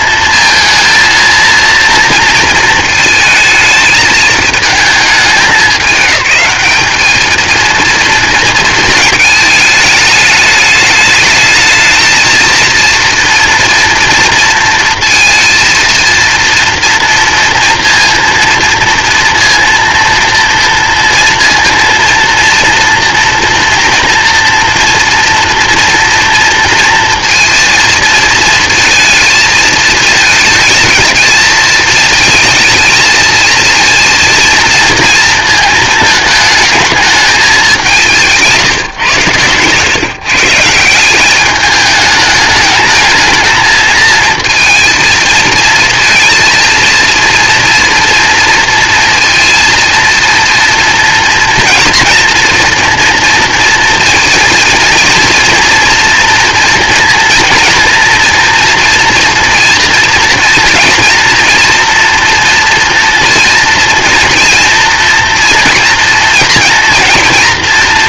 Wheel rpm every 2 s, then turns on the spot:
230, 220, 220, 210, 230, 210, 230, 230, 230, 230, 230, 230, 230, 230, 230, 220, 220, 230, 220, 150, 150, 210, 230, 230, 230, 230, 230, 230, 230, 230, 240, 230, 230, 230.
38-40